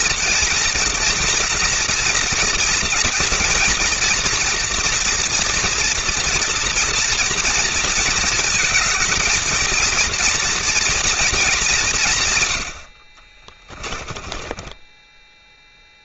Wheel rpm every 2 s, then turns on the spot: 230, 230, 240, 230, 220, 230, 50, 10.
12-16